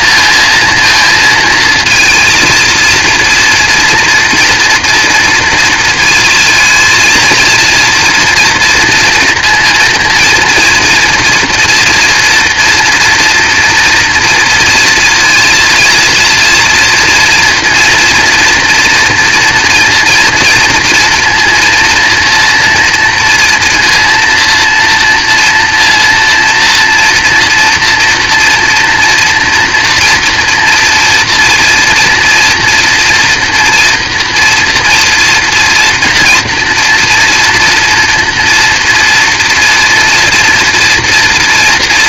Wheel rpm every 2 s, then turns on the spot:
230, 230, 230, 230, 230, 230, 240, 230, 230, 240, 230, 230, 230, 230, 240, 240, 230, 230, 230, 230, 230.
none